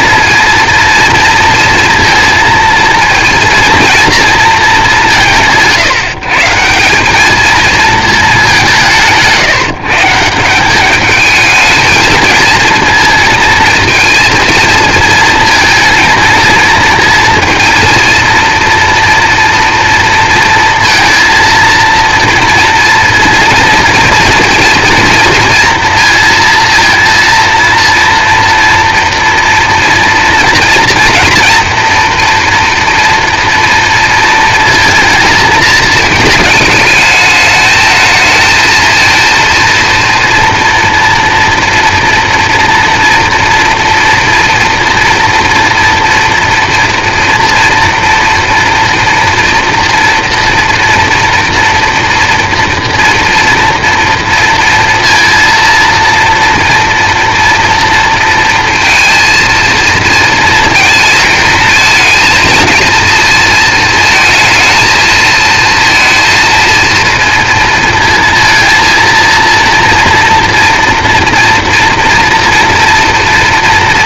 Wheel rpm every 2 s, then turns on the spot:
230, 230, 200, 190, 170, 200, 230, 230, 230, 240, 230, 240, 230, 230, 230, 230, 230, 230, 220, 230, 230, 230, 240, 230, 230, 240, 230, 230, 230, 230, 230, 230, 230, 230, 230, 230, 240.
none